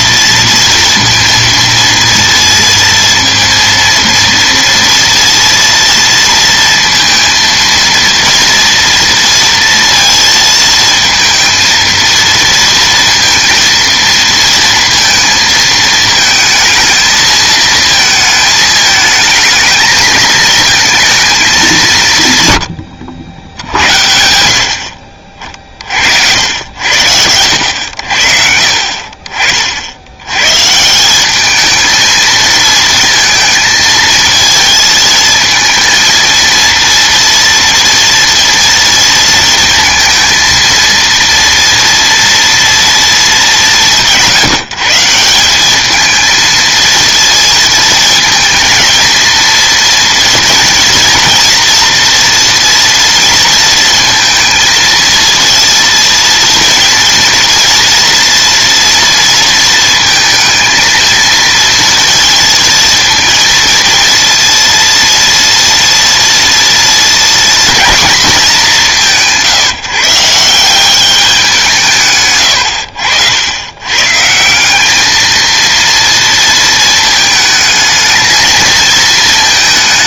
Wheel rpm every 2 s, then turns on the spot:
230, 230, 230, 230, 230, 230, 230, 230, 220, 220, 230, 100, 50, 80, 50, 140, 220, 220, 230, 230, 230, 230, 160, 230, 230, 230, 240, 230, 230, 240, 230, 230, 230, 230, 190, 180, 100, 190, 230, 220.
none